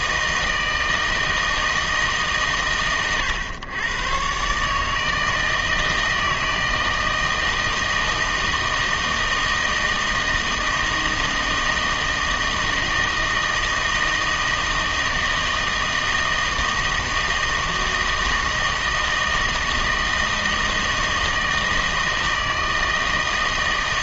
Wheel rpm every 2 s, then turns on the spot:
160, 120, 140, 160, 160, 160, 160, 160, 160, 160, 160, 160.
none